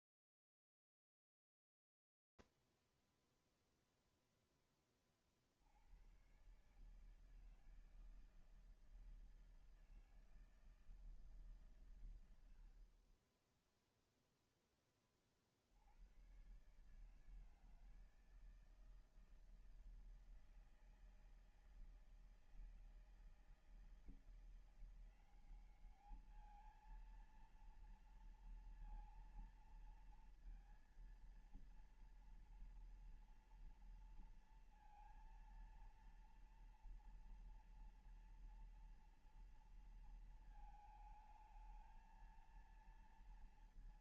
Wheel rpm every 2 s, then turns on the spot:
0, 0, 0, 80, 160, 160, 100, 0, 120, 160, 160, 160, 170, 210, 230, 230, 230, 230, 230, 230, 220, 220.
none